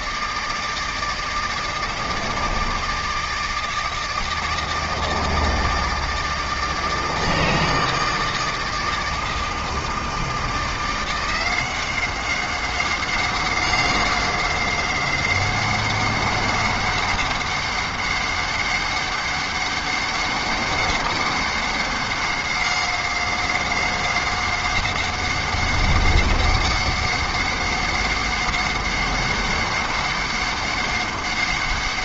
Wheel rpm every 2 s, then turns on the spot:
160, 160, 160, 160, 160, 170, 190, 190, 200, 200, 200, 190, 190, 190, 190, 200.
none